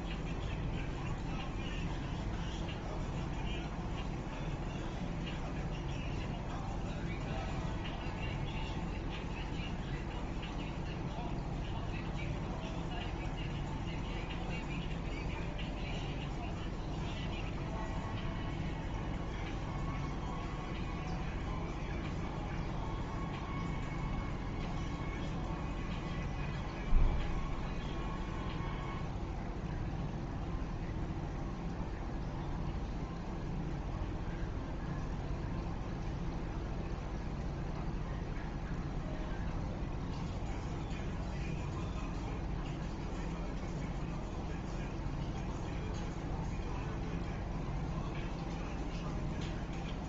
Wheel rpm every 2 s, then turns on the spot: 0, 0, 0, 0, 0, 0, 0, 0, 0, 0, 0, 0, 0, 0, 0, 0, 0, 0, 0, 0, 0, 0, 0, 0, 0.
none